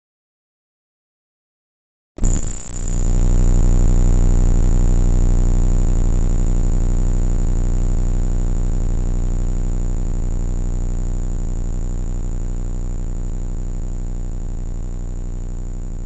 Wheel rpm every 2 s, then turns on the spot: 0, 0, 0, 0, 0, 0, 0, 0.
none